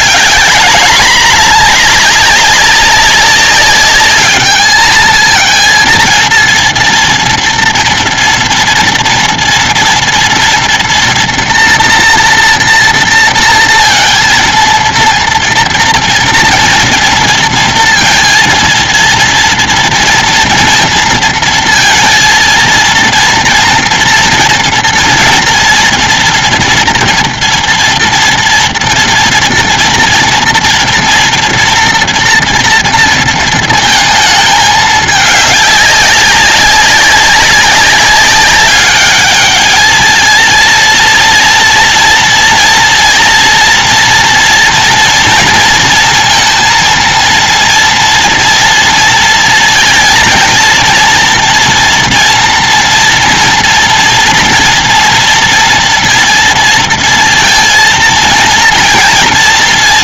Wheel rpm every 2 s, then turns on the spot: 200, 200, 210, 230, 230, 230, 240, 220, 230, 230, 240, 230, 240, 240, 230, 230, 230, 220, 200, 190, 220, 230, 230, 230, 240, 220, 230, 230, 230, 230.
none